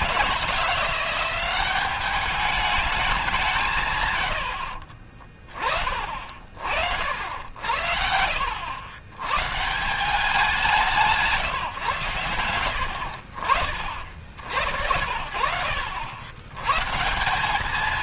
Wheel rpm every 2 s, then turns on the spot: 170, 200, 40, 70, 110, 170, 80, 60, 130.
4-6